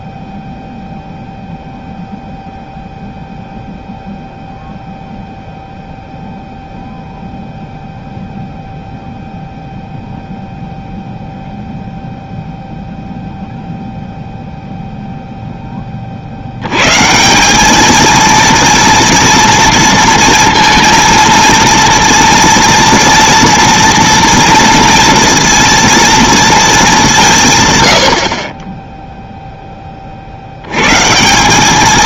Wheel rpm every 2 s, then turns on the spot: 0, 0, 0, 0, 0, 0, 0, 0, 110, 230, 230, 230, 230, 230, 30, 80.
none